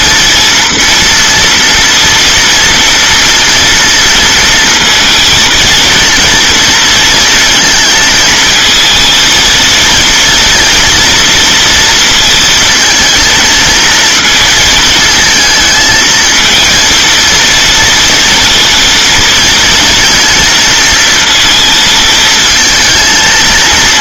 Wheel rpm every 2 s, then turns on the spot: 230, 230, 230, 230, 220, 230, 230, 220, 230, 230, 220, 230.
none